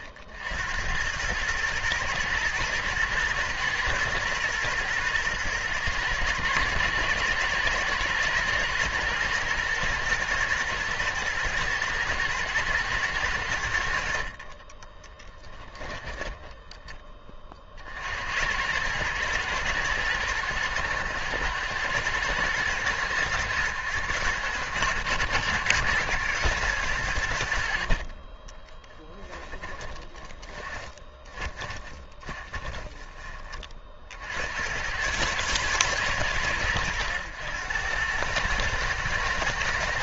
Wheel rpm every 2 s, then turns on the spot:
20, 110, 120, 110, 110, 110, 110, 70, 20, 70, 110, 110, 110, 110, 30, 20, 20, 80, 90, 110.
16-18 28-34